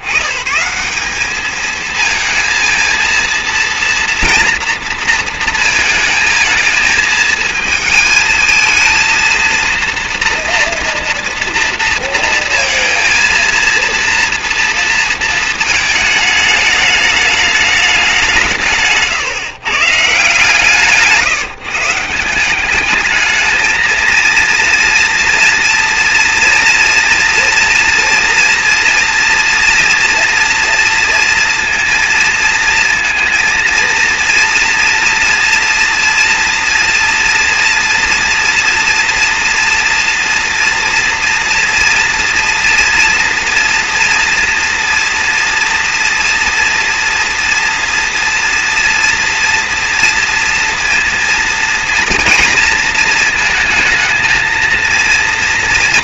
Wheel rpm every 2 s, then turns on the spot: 80, 230, 230, 230, 230, 230, 230, 240, 220, 180, 150, 180, 230, 230, 230, 230, 230, 230, 230, 240, 230, 230, 230, 240, 230, 230, 230, 220.
none